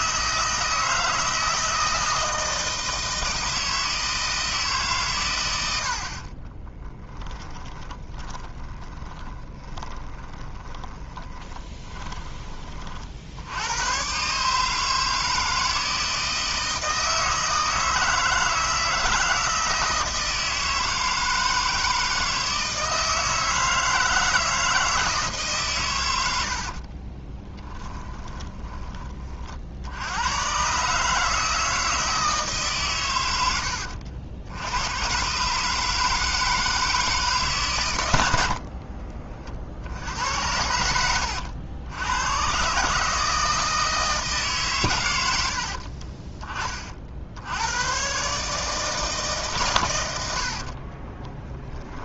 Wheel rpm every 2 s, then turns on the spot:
160, 160, 150, 20, 10, 20, 40, 150, 160, 160, 160, 160, 160, 40, 30, 130, 130, 90, 160, 50, 90, 130, 130, 30, 150, 50.
6-12 26-30 38-40 50-52